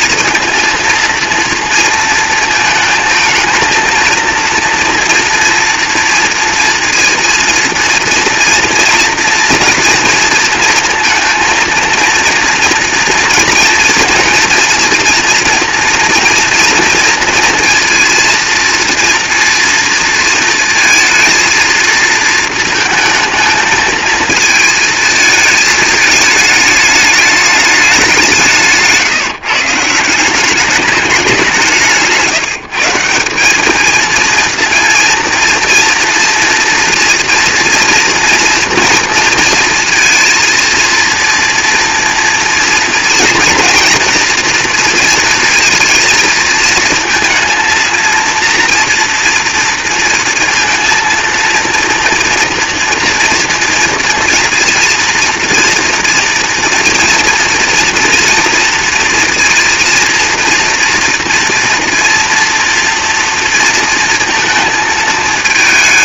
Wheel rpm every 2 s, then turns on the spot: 230, 220, 230, 230, 230, 230, 230, 240, 230, 230, 230, 230, 220, 210, 160, 200, 160, 230, 240, 230, 230, 230, 230, 230, 240, 230, 230, 230, 230, 230, 230, 230, 230.
28-30